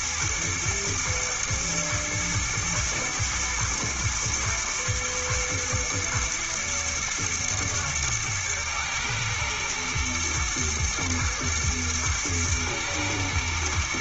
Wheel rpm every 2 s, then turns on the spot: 120, 110, 120, 120, 110, 120, 120.
none